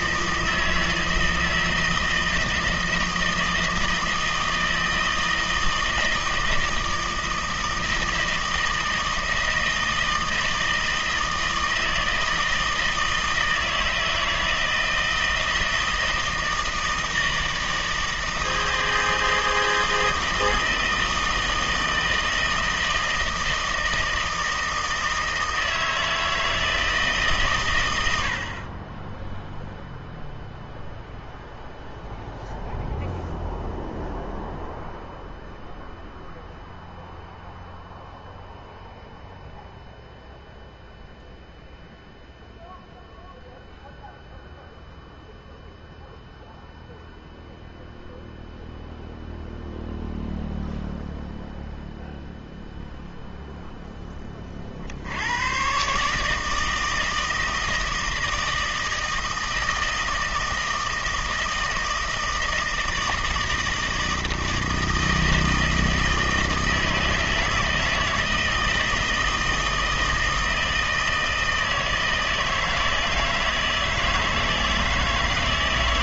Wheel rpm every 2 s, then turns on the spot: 160, 160, 160, 160, 160, 160, 160, 160, 160, 160, 160, 160, 160, 160, 40, 0, 0, 0, 0, 0, 0, 0, 0, 0, 0, 0, 0, 40, 160, 160, 160, 160, 160, 160, 160, 160, 160, 160.
none